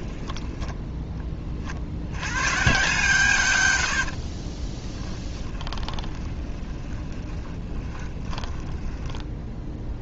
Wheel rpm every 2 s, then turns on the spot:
10, 130, 10, 20, 10.
0-2 4-10